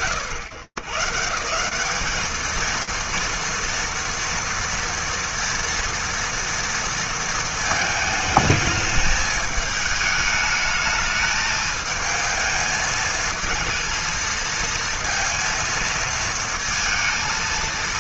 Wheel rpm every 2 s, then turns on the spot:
110, 230, 230, 230, 220, 220, 220, 230, 230.
none